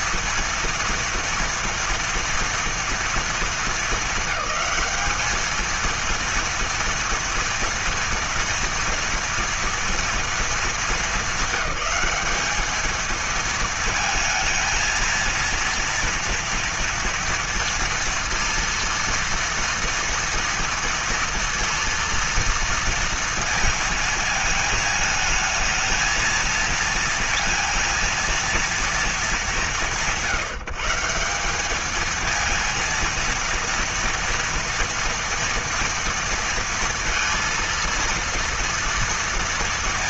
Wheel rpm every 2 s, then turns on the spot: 230, 230, 200, 230, 240, 230, 210, 220, 230, 230, 230, 230, 220, 230, 230, 170, 230, 230, 230, 230.
none